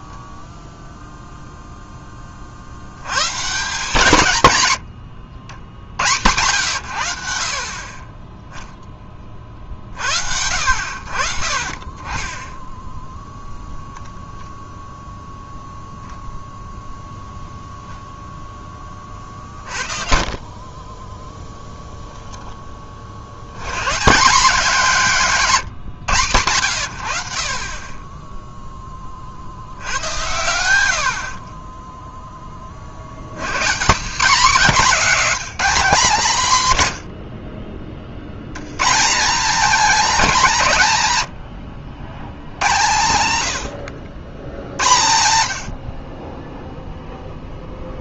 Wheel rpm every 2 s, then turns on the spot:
0, 90, 110, 80, 10, 60, 0, 0, 0, 20, 20, 40, 210, 70, 10, 80, 50, 250, 130, 150, 150, 110, 100, 0.
none